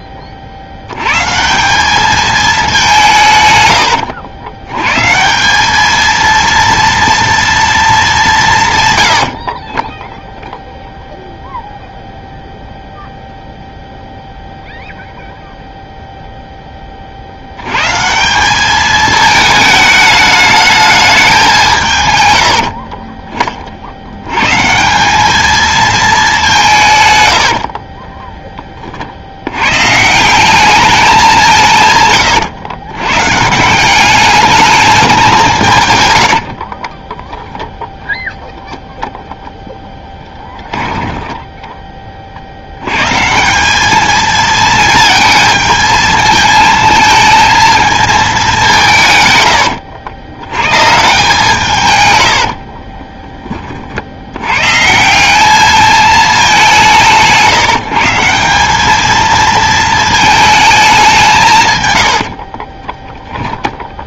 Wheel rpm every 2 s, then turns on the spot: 50, 200, 110, 230, 150, 0, 0, 0, 10, 200, 220, 70, 140, 170, 20, 200, 120, 210, 40, 0, 10, 80, 220, 220, 180, 120, 50, 130, 190, 190, 220, 40.
22-24 36-38 52-54 62-64